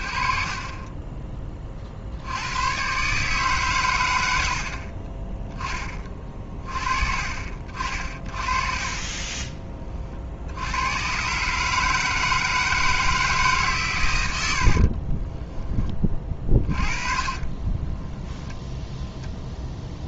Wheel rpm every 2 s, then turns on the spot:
40, 110, 60, 40, 40, 90, 160, 80, 30, 0.
14-18